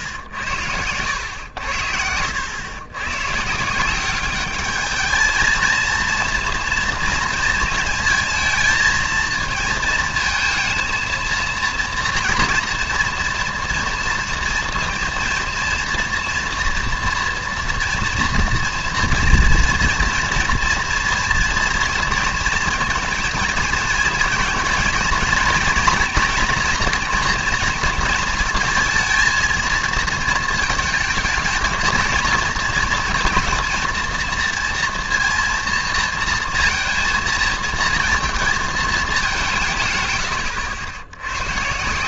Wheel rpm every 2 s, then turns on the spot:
90, 100, 210, 230, 220, 230, 240, 230, 230, 230, 230, 230, 220, 230, 230, 230, 230, 230, 230, 220, 100.
none